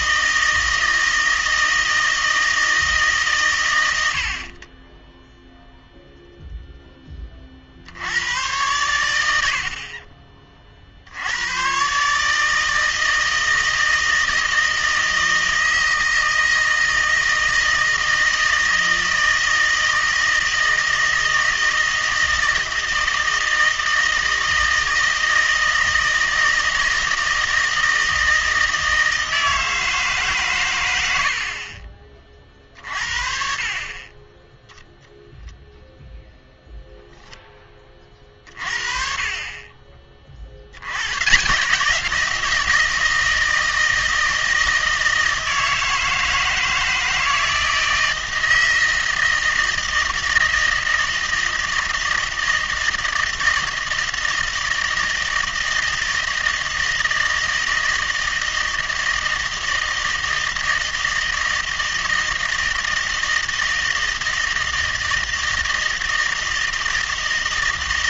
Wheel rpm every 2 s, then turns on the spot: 160, 160, 10, 10, 100, 60, 160, 160, 160, 160, 160, 160, 160, 160, 160, 110, 50, 0, 0, 40, 90, 160, 160, 160, 160, 160, 160, 160, 160, 160, 160, 160, 160, 160.
none